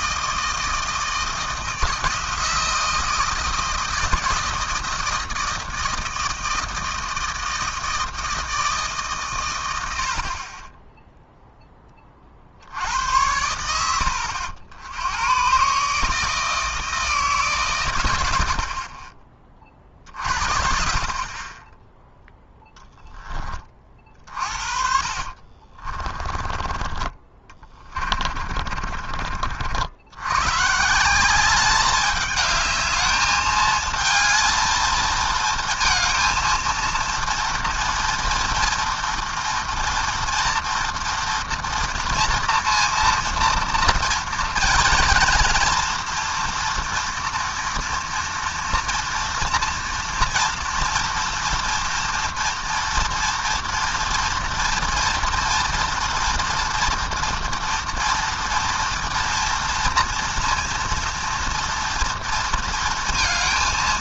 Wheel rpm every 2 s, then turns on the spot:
160, 160, 160, 160, 160, 20, 70, 80, 160, 50, 40, 0, 50, 30, 40, 140, 210, 230, 230, 230, 230, 230, 230, 240, 230, 240, 230, 230, 230, 230, 230, 230.
24-30